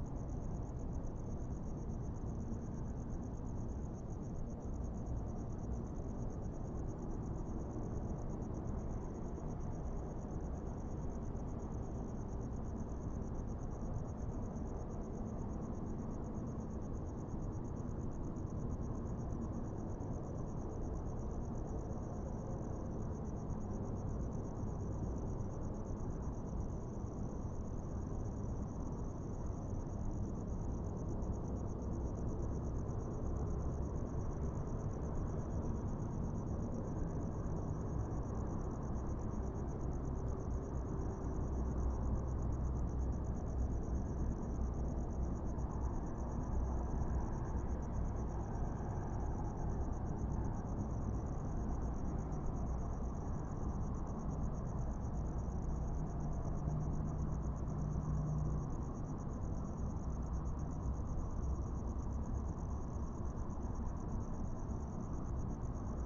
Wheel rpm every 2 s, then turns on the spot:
0, 0, 0, 0, 0, 0, 0, 0, 0, 0, 0, 0, 0, 0, 0, 0, 0, 0, 0, 0, 0, 0, 0, 0, 0, 0, 0, 0, 0, 0, 0, 0, 0.
none